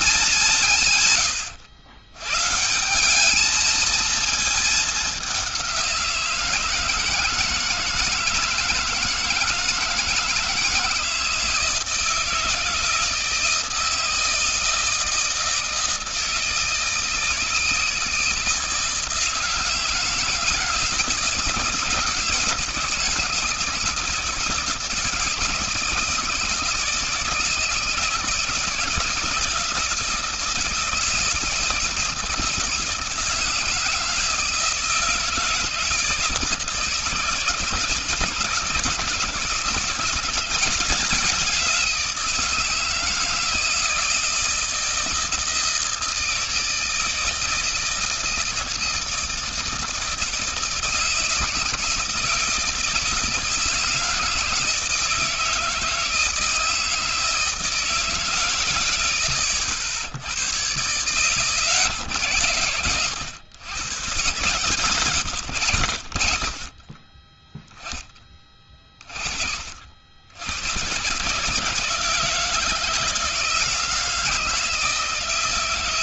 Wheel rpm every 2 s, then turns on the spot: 180, 140, 220, 170, 160, 160, 160, 160, 160, 160, 160, 150, 150, 160, 160, 170, 160, 160, 150, 160, 190, 160, 160, 160, 160, 160, 160, 160, 160, 140, 90, 80, 120, 30, 20, 90, 160, 160.
none